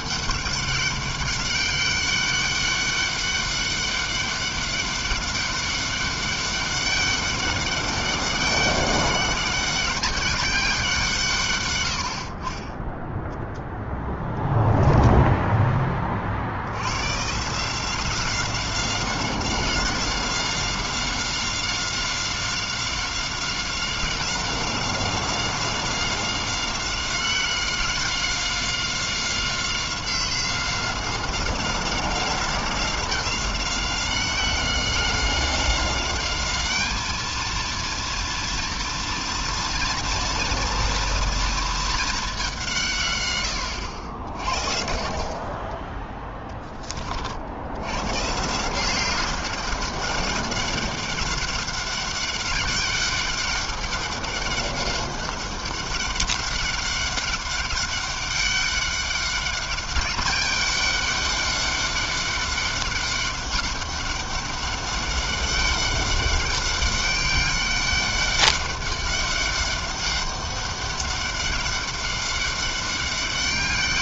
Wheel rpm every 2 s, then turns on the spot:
200, 200, 200, 200, 200, 140, 0, 10, 140, 190, 190, 190, 190, 190, 190, 190, 190, 190, 220, 230, 230, 130, 40, 50, 190, 200, 200, 200, 200, 200, 200, 200, 200, 200, 200, 200, 200.
none